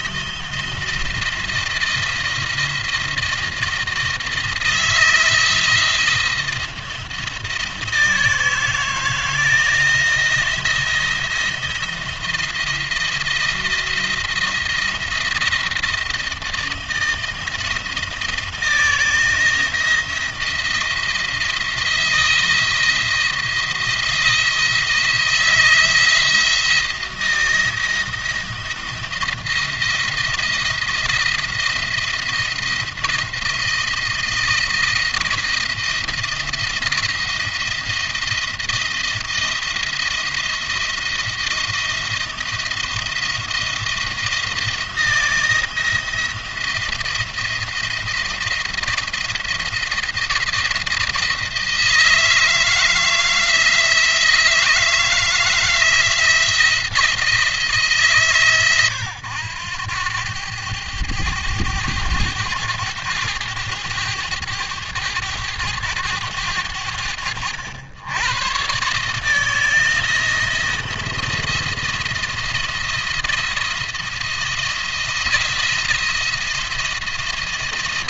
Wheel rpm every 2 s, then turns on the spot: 170, 170, 170, 170, 160, 170, 170, 170, 160, 160, 170, 160, 160, 170, 170, 170, 170, 170, 170, 170, 170, 170, 170, 170, 170, 160, 160, 160, 170, 120, 100, 100, 100, 90, 130, 170, 170, 170, 170.
none